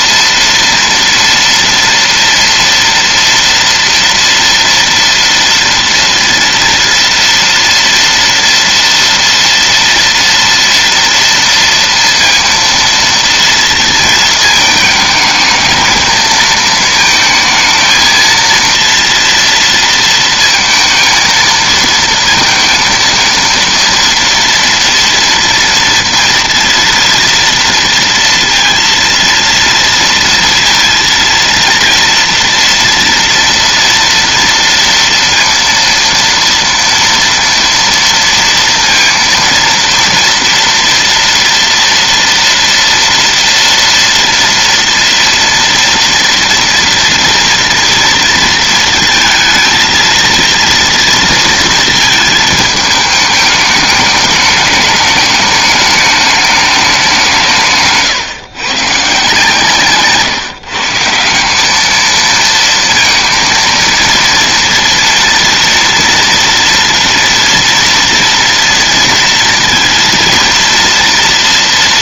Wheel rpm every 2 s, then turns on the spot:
240, 230, 230, 230, 230, 230, 230, 220, 220, 230, 230, 230, 230, 230, 230, 230, 230, 230, 230, 230, 230, 230, 230, 240, 230, 230, 220, 210, 210, 130, 160, 230, 230, 230, 230, 230.
none